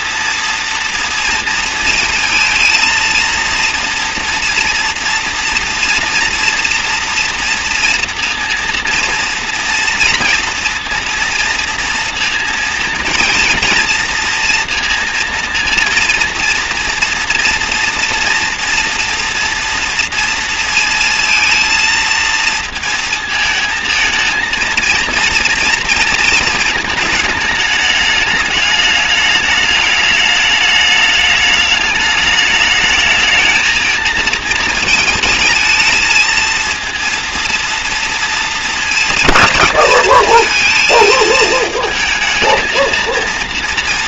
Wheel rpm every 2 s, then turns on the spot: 230, 230, 240, 240, 230, 230, 230, 230, 240, 230, 230, 230, 220, 220, 210, 210, 220, 220, 230, 230, 230, 220.
none